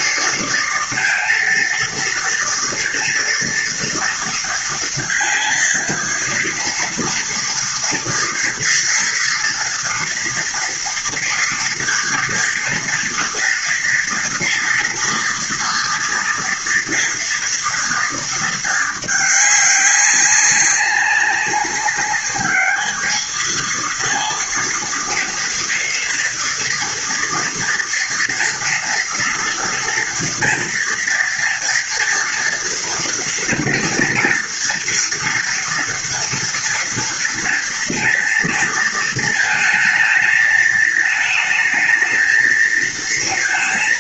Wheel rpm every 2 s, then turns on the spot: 230, 230, 230, 230, 230, 230, 230, 230, 230, 210, 200, 210, 230, 230, 230, 240, 240, 230, 230, 220, 220, 230.
none